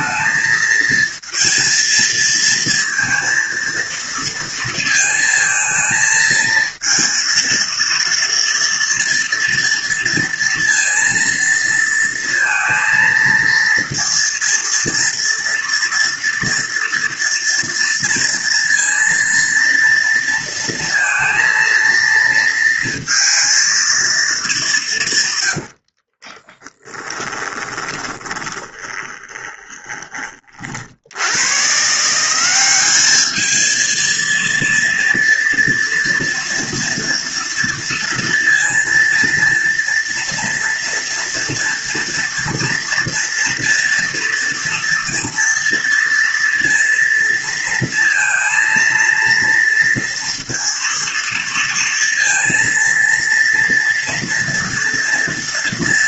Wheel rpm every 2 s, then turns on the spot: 230, 230, 230, 230, 230, 230, 230, 230, 230, 230, 230, 230, 170, 10, 20, 60, 200, 230, 230, 230, 230, 230, 240, 230, 230, 230, 230, 230.
26-30